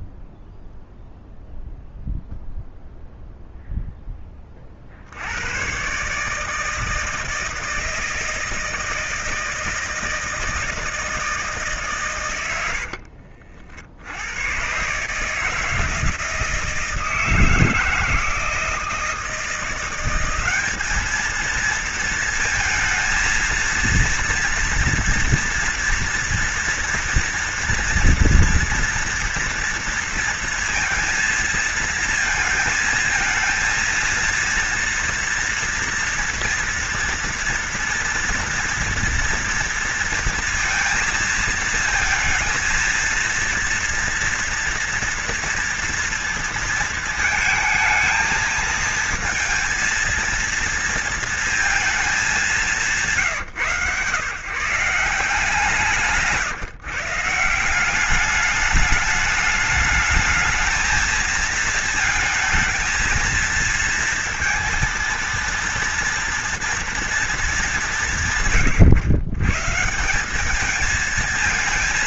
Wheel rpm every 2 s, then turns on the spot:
0, 0, 60, 160, 160, 160, 60, 140, 160, 160, 220, 220, 230, 230, 230, 230, 230, 230, 230, 230, 230, 230, 230, 230, 230, 230, 170, 180, 160, 210, 220, 230, 230, 230, 120, 220.
12-14